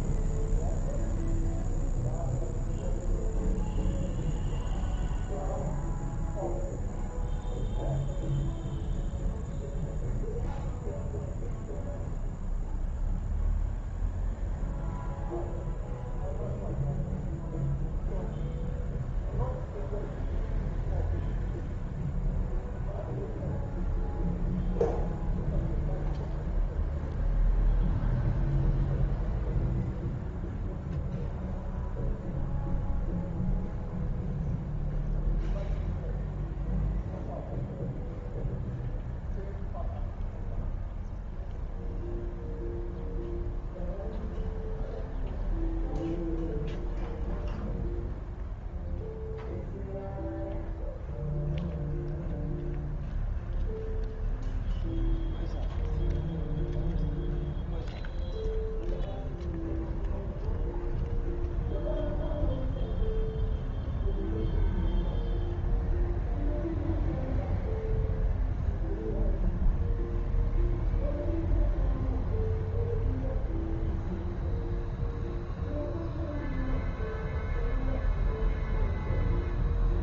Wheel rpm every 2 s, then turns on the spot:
0, 0, 0, 0, 0, 0, 0, 0, 0, 0, 0, 0, 0, 0, 0, 0, 0, 0, 0, 0, 0, 0, 0, 0, 0, 0, 0, 0, 0, 0, 0, 0, 0, 0, 0, 0, 0, 0, 0, 0.
none